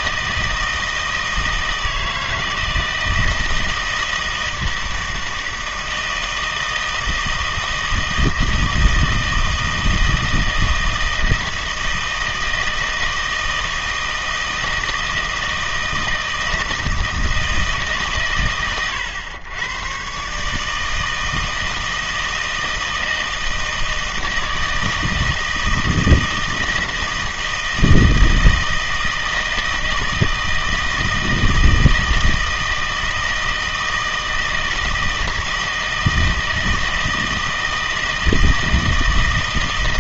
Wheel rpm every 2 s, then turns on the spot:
160, 160, 160, 160, 160, 160, 160, 160, 160, 110, 150, 160, 160, 160, 160, 160, 160, 160, 160, 160.
none